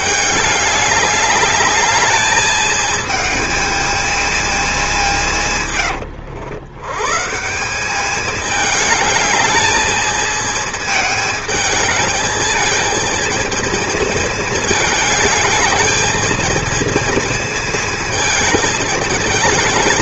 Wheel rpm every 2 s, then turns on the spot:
210, 210, 210, 90, 210, 220, 220, 220, 220, 220.
none